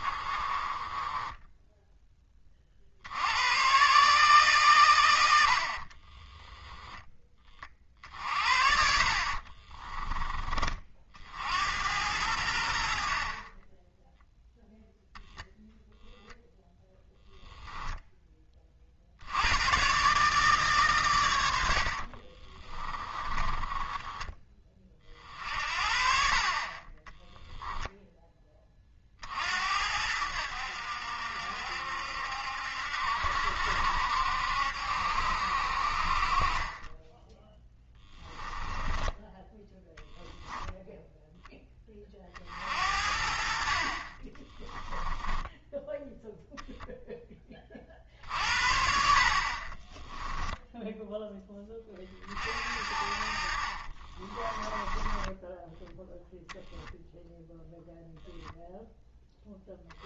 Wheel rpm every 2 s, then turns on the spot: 20, 40, 120, 10, 50, 40, 70, 0, 10, 50, 140, 20, 30, 20, 30, 70, 70, 70, 20, 10, 0, 50, 10, 0, 60, 10, 50, 20, 0, 0.
0-2 22-24 38-40 44-46 54-56